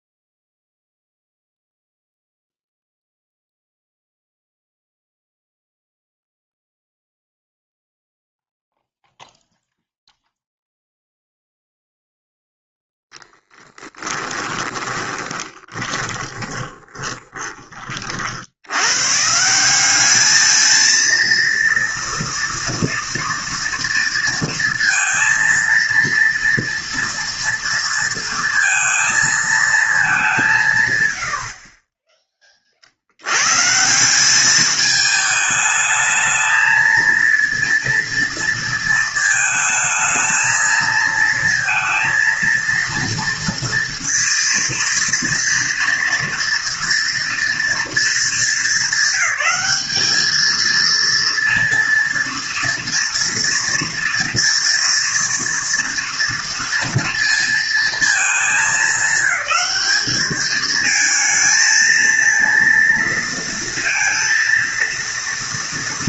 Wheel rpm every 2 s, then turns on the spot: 0, 0, 0, 0, 0, 0, 0, 20, 20, 80, 230, 230, 230, 230, 230, 150, 30, 210, 220, 230, 220, 230, 230, 230, 210, 220, 230, 230, 230, 210, 210, 230, 230.
14-18